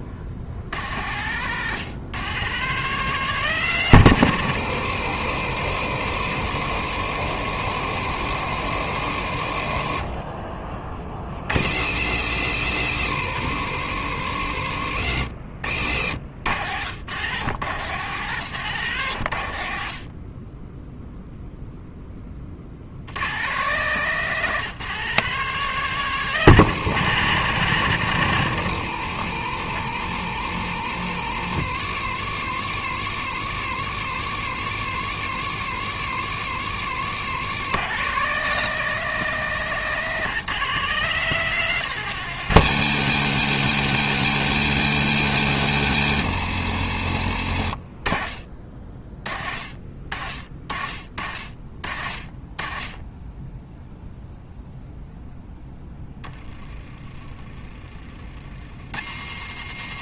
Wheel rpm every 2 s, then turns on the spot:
100, 150, 80, 70, 60, 30, 80, 60, 100, 100, 0, 80, 160, 120, 70, 70, 70, 70, 80, 160, 170, 120, 100, 60, 40, 40, 20, 0, 30, 80.
36-38